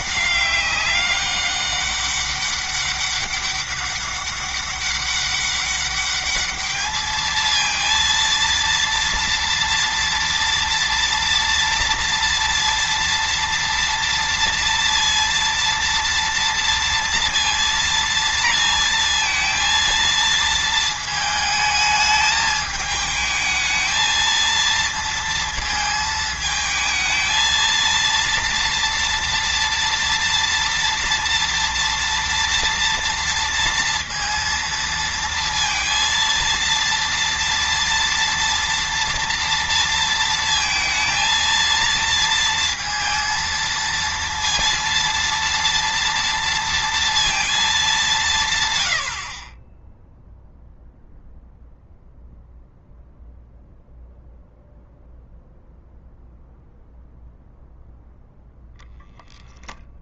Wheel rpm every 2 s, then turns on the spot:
200, 200, 200, 220, 230, 230, 230, 230, 230, 230, 220, 220, 230, 220, 230, 230, 230, 230, 230, 230, 220, 230, 230, 230, 100, 0, 0, 0, 0, 0.
none